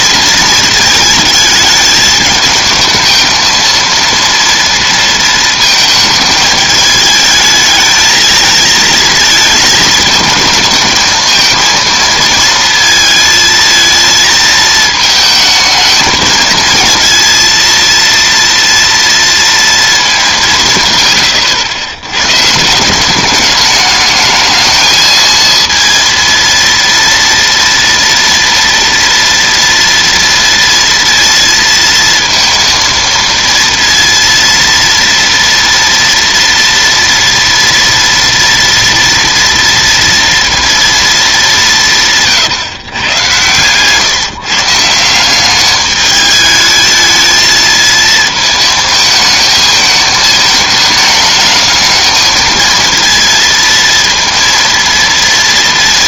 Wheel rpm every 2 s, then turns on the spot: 220, 220, 230, 220, 220, 220, 230, 220, 230, 230, 150, 160, 220, 230, 230, 230, 230, 230, 230, 230, 230, 140, 160, 220, 220, 220, 230, 230.
none